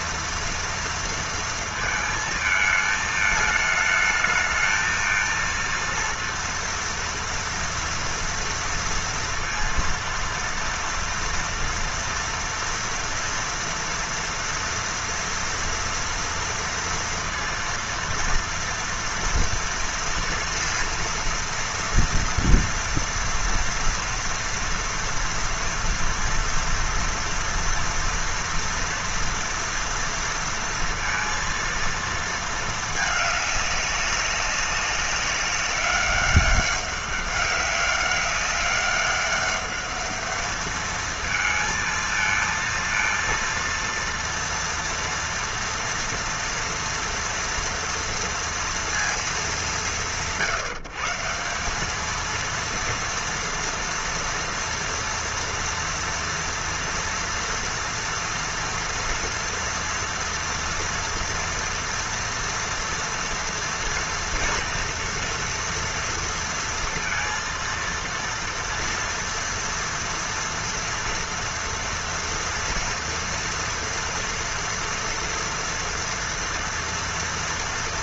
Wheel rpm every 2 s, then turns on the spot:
230, 220, 220, 230, 230, 230, 230, 230, 230, 230, 230, 230, 230, 230, 230, 230, 230, 200, 200, 200, 210, 230, 230, 230, 230, 140, 230, 230, 230, 230, 230, 240, 230, 230, 230, 230, 230, 230, 230.
none